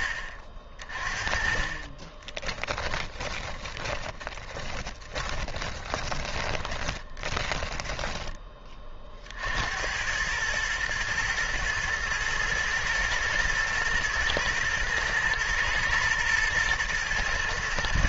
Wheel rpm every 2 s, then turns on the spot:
40, 10, 30, 20, 20, 110, 110, 110, 120.
2-8